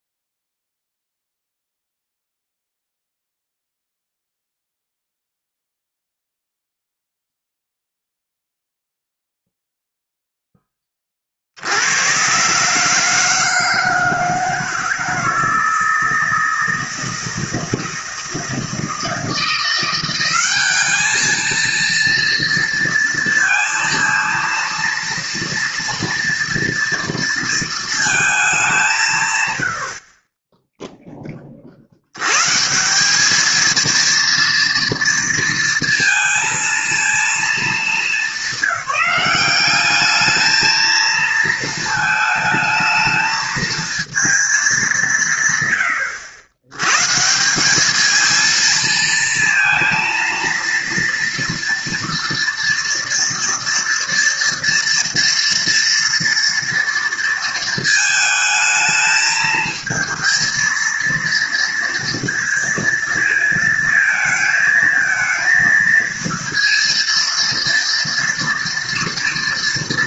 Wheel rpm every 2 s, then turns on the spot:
0, 0, 0, 0, 0, 10, 130, 160, 160, 160, 200, 230, 230, 230, 200, 20, 140, 230, 230, 210, 220, 220, 220, 90, 220, 230, 230, 230, 230, 220, 230, 230, 220, 230, 230.
none